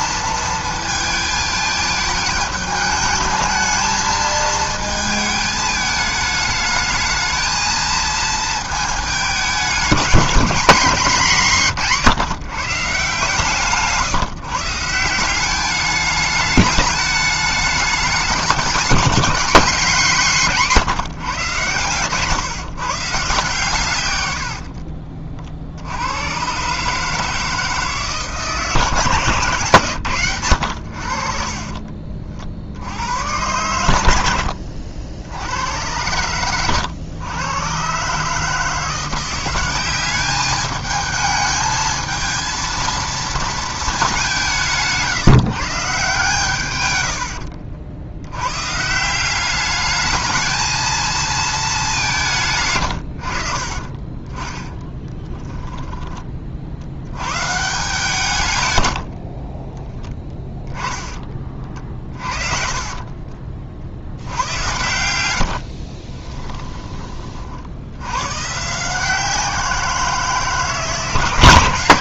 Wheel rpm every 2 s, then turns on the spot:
220, 220, 220, 220, 220, 220, 160, 160, 210, 210, 180, 150, 80, 130, 150, 100, 70, 70, 110, 160, 210, 230, 160, 130, 140, 220, 140, 10, 40, 110, 10, 40, 90, 10, 140, 150.
24-26 44-46 52-56 62-64